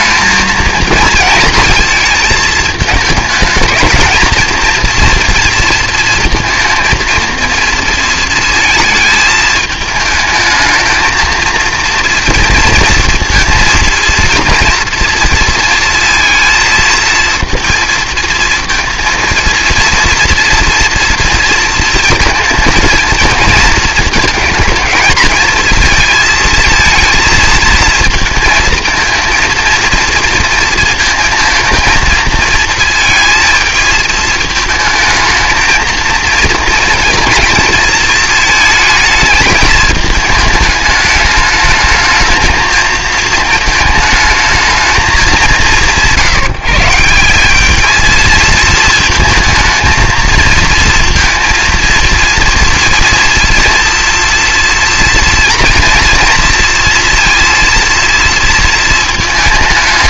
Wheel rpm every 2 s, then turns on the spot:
230, 220, 230, 230, 220, 220, 230, 230, 230, 230, 230, 230, 220, 220, 220, 230, 230, 220, 230, 220, 210, 220, 220, 170, 230, 230, 230, 230, 230, 220.
none